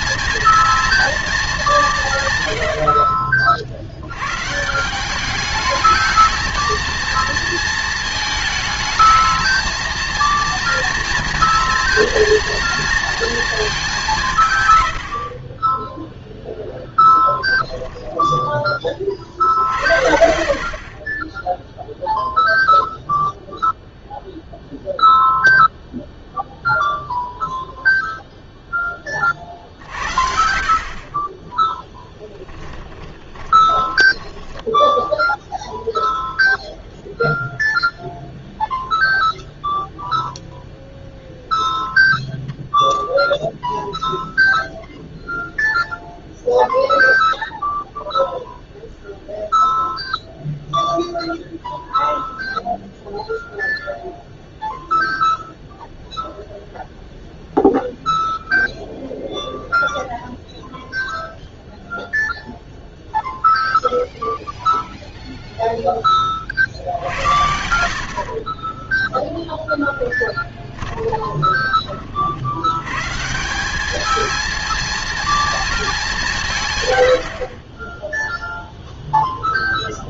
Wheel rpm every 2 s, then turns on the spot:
230, 110, 140, 220, 220, 230, 230, 130, 0, 10, 50, 0, 0, 0, 0, 60, 10, 10, 0, 0, 0, 0, 0, 0, 0, 0, 0, 0, 0, 0, 0, 0, 0, 40, 30, 10, 80, 220, 160, 0.
32-34 70-72